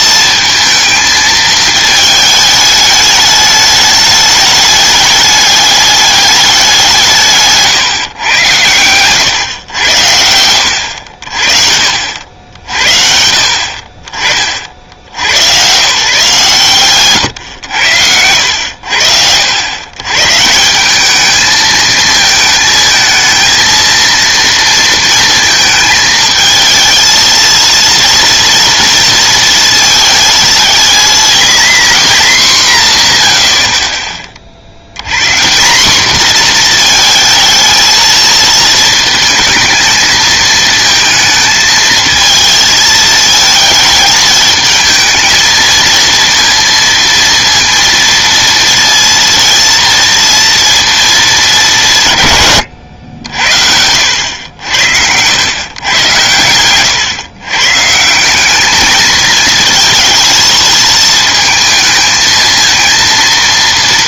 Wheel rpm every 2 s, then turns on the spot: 220, 210, 210, 200, 110, 90, 60, 50, 140, 100, 170, 220, 230, 220, 230, 230, 190, 60, 230, 220, 220, 220, 220, 230, 230, 230, 120, 80, 110, 200, 230, 230.
56-58